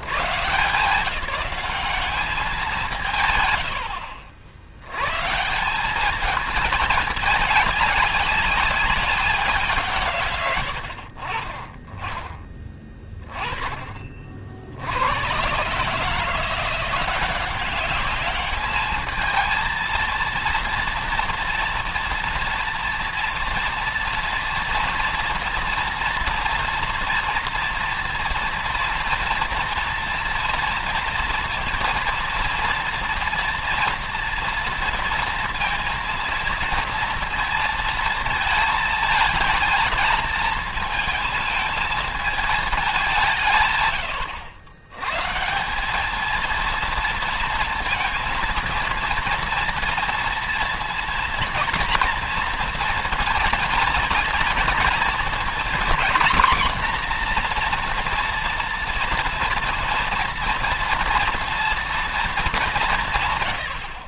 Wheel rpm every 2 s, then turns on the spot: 160, 170, 80, 220, 200, 80, 20, 80, 170, 220, 230, 230, 230, 230, 240, 230, 230, 240, 230, 220, 220, 200, 110, 230, 230, 230, 230, 220, 240, 240, 230, 180.
none